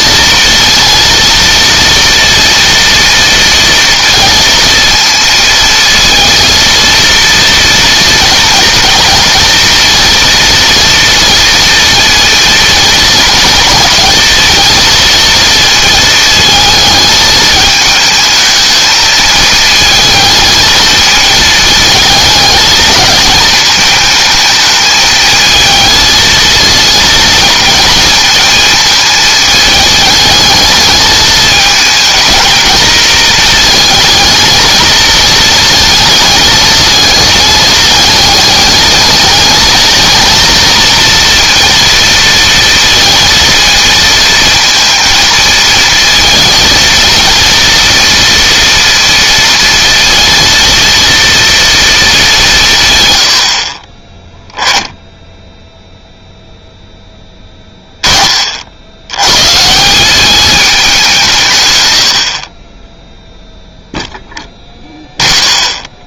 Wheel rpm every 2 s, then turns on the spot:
230, 230, 230, 230, 230, 230, 230, 220, 220, 220, 220, 220, 220, 230, 220, 220, 230, 230, 220, 210, 230, 230, 230, 230, 230, 230, 150, 10, 0, 60, 200, 20, 0.
none